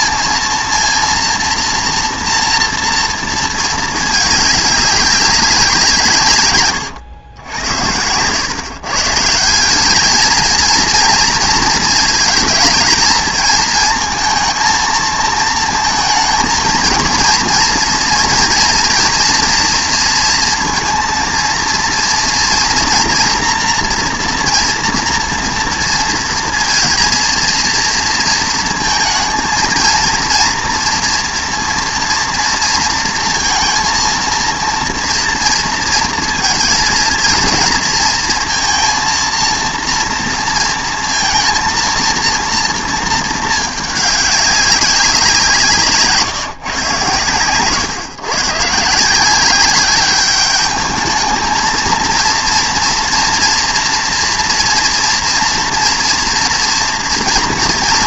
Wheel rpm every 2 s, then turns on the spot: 230, 230, 210, 130, 140, 230, 220, 220, 230, 240, 230, 240, 240, 230, 230, 230, 230, 230, 230, 230, 230, 230, 200, 140, 140, 210, 230, 230, 230.
none